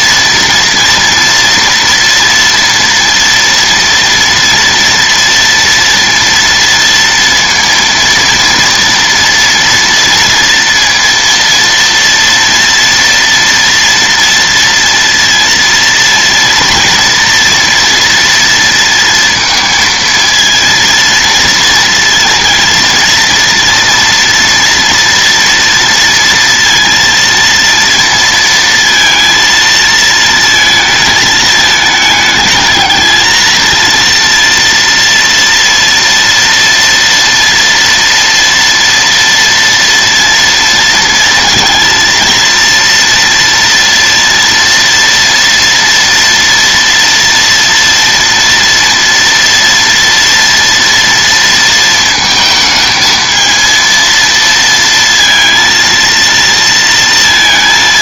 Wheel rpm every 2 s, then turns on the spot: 230, 230, 240, 230, 230, 230, 230, 230, 230, 230, 230, 230, 230, 230, 230, 230, 220, 230, 230, 230, 230, 230, 230, 240, 230, 230, 220, 230, 230.
none